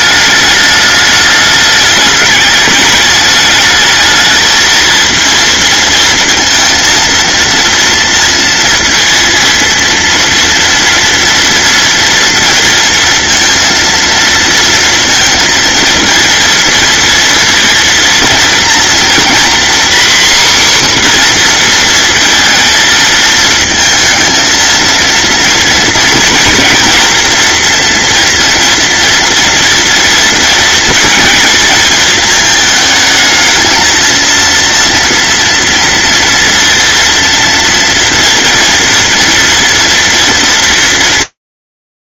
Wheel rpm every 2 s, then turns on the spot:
210, 210, 230, 230, 230, 230, 230, 230, 230, 230, 260, 230, 230, 240, 230, 230, 220, 230, 230, 230, 200.
none